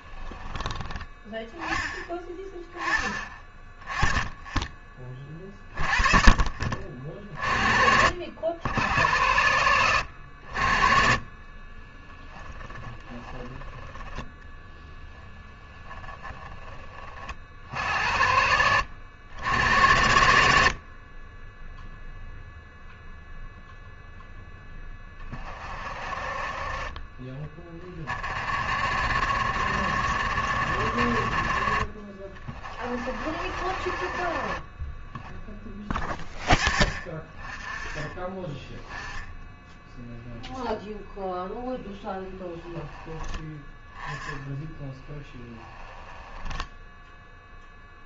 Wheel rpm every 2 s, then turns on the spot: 20, 10, 20, 50, 90, 50, 10, 10, 20, 80, 50, 0, 20, 30, 50, 60, 40, 30, 20, 10, 0, 20, 10, 10.
12-16 42-48